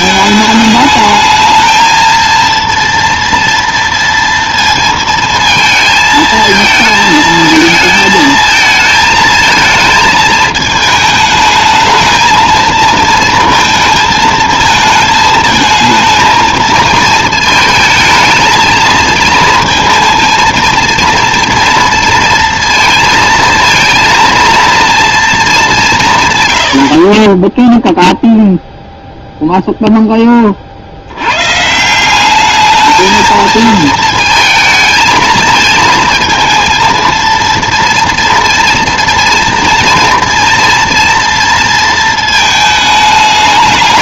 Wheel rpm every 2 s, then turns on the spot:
210, 230, 230, 220, 220, 220, 230, 220, 230, 220, 230, 230, 230, 90, 0, 40, 210, 220, 220, 230, 230, 220.
none